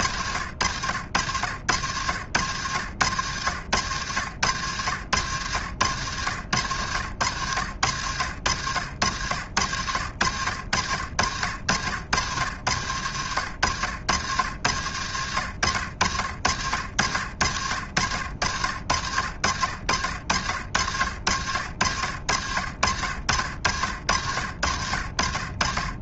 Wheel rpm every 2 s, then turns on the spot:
70, 90, 90, 90, 80, 70, 80, 90, 70, 70, 70, 70, 70.
none